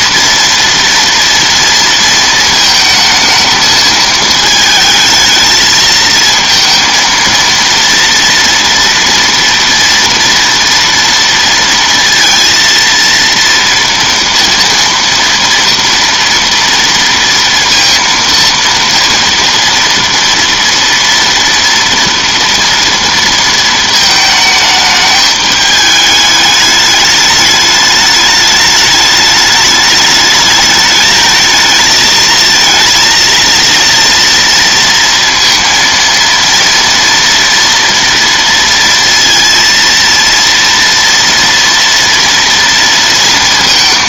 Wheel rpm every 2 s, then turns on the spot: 230, 220, 220, 230, 230, 230, 230, 230, 230, 230, 230, 230, 210, 210, 210, 210, 230, 230, 240, 230, 230, 230.
none